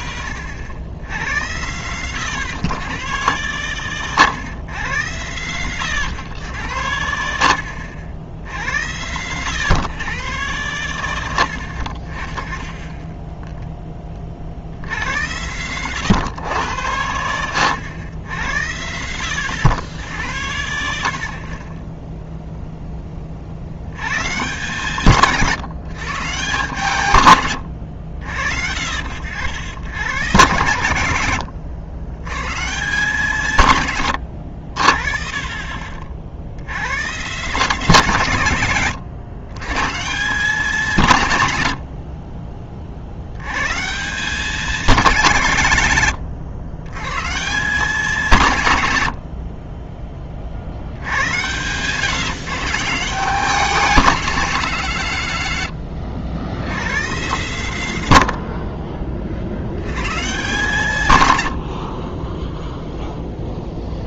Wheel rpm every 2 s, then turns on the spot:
80, 110, 100, 90, 60, 100, 30, 40, 100, 60, 80, 0, 150, 150, 70, 140, 140, 80, 90, 140, 170, 30, 190, 100, 120, 50, 150, 190, 120, 50, 130, 0.
58-60